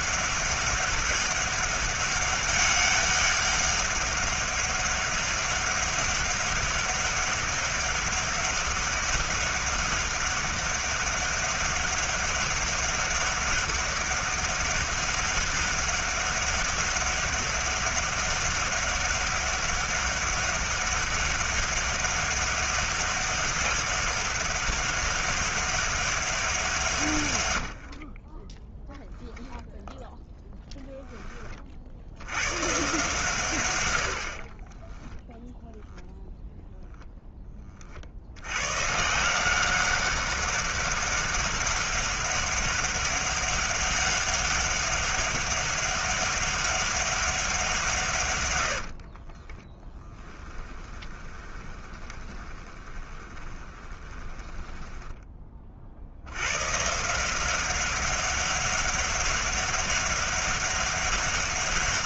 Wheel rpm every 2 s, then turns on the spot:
200, 200, 200, 200, 200, 200, 200, 200, 200, 200, 200, 200, 200, 170, 10, 0, 130, 20, 0, 110, 200, 200, 200, 200, 80, 10, 20, 10, 140, 200, 200.
28-30 34-36 50-56